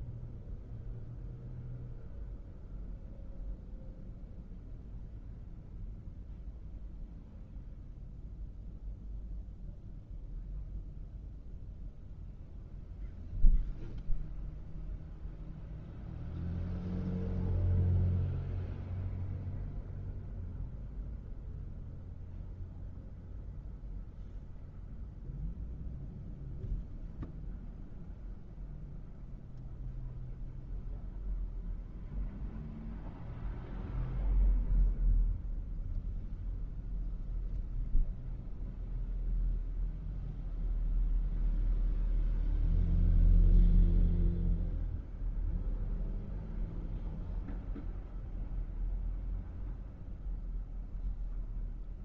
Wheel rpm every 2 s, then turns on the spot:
0, 0, 0, 0, 0, 0, 0, 0, 0, 0, 0, 0, 0, 0, 0, 0, 0, 0, 0, 0, 0, 0, 0, 0, 0, 0.
none